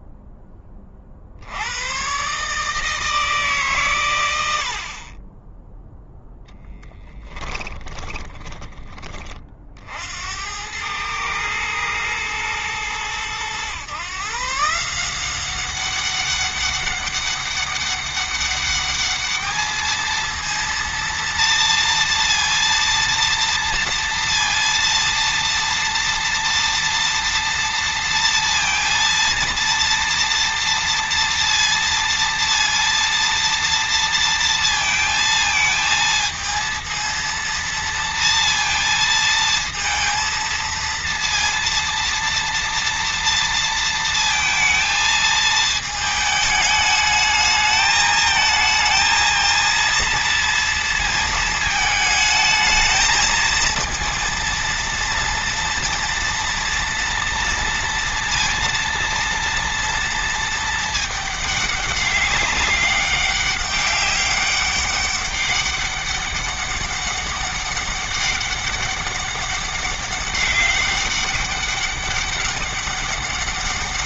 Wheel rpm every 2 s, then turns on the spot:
10, 140, 90, 10, 20, 90, 110, 150, 200, 200, 230, 230, 230, 230, 230, 230, 230, 230, 230, 230, 230, 230, 230, 220, 220, 230, 220, 230, 230, 230, 220, 200, 200, 200, 200, 200, 200.
none